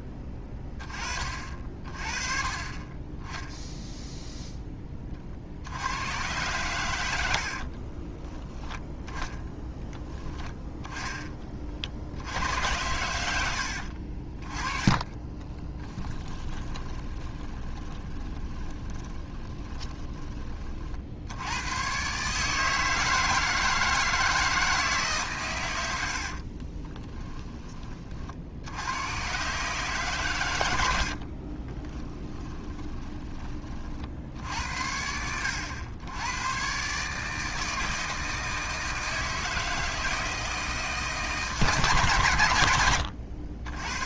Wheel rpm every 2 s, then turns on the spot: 30, 30, 20, 100, 10, 10, 90, 20, 20, 20, 50, 150, 150, 20, 90, 90, 20, 70, 140, 160, 160, 100.
14-20 26-28 32-34 42-44